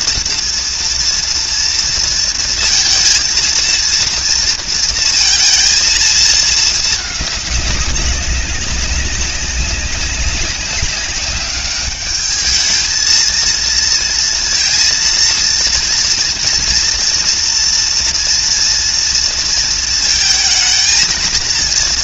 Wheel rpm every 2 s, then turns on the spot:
230, 230, 230, 220, 200, 190, 210, 230, 230, 230, 230.
none